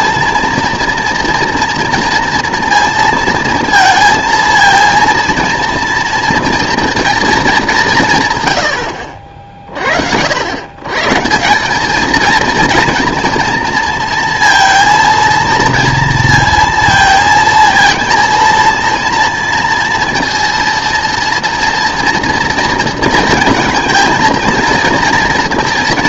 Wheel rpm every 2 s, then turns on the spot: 230, 230, 230, 240, 90, 130, 230, 230, 230, 230, 230, 230, 230.
none